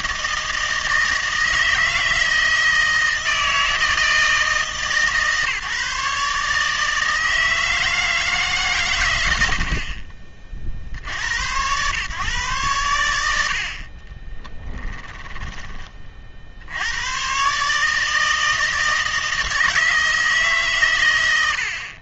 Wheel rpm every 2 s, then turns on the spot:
160, 160, 160, 160, 140, 50, 120, 10, 70, 160, 140.
14-16